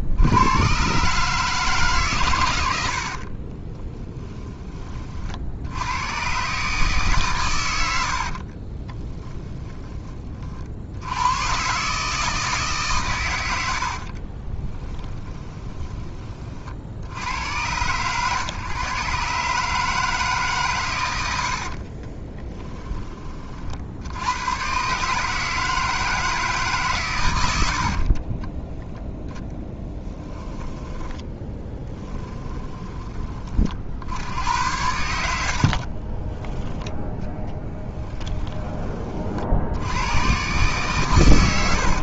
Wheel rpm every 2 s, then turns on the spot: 130, 80, 30, 150, 20, 70, 130, 20, 60, 130, 120, 20, 130, 140, 0, 10, 20, 80, 10, 30, 110.
8-10 14-16 30-34